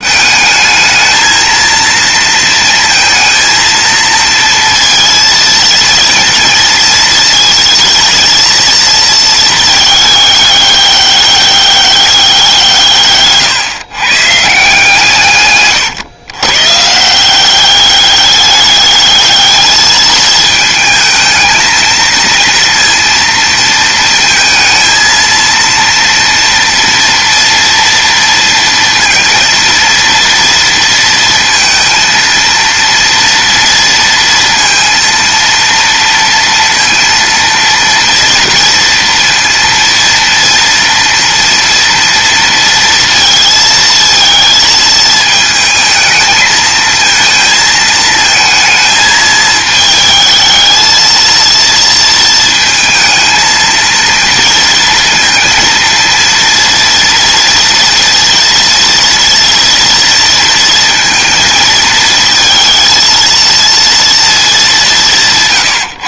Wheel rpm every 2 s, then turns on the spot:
220, 230, 230, 230, 230, 200, 160, 160, 150, 210, 220, 230, 230, 240, 230, 230, 230, 230, 230, 230, 230, 230, 220, 220, 220, 220, 230, 230, 230, 230, 230, 220, 200.
none